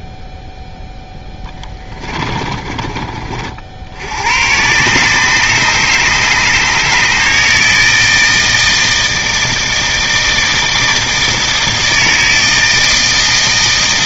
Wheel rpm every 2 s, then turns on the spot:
10, 50, 140, 160, 160, 160, 150.
0-2